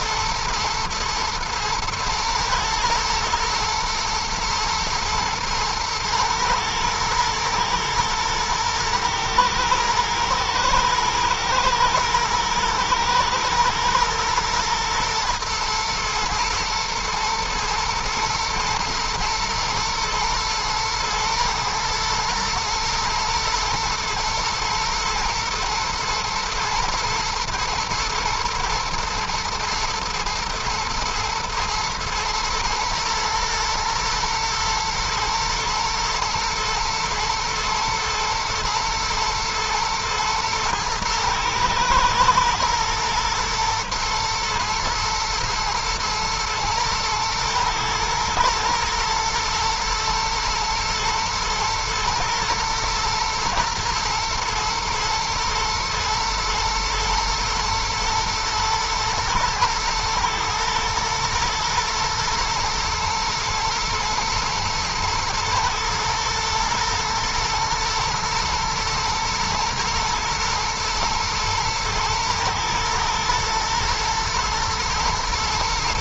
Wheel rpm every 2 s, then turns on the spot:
110, 120, 110, 110, 110, 110, 110, 110, 110, 110, 120, 110, 110, 120, 120, 120, 110, 110, 110, 120, 110, 120, 120, 110, 110, 120, 120, 110, 110, 110, 110, 110, 110, 120, 120, 110, 110, 110.
none